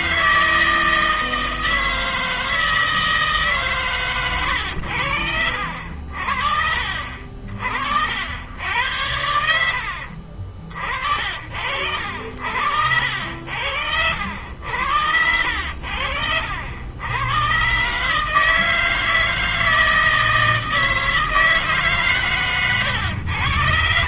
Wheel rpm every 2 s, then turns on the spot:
160, 160, 130, 60, 70, 70, 70, 90, 70, 130, 160, 140.
10-12